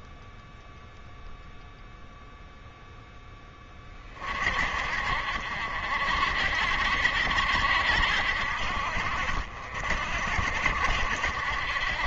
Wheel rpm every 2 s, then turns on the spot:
0, 0, 50, 60, 60, 70.
none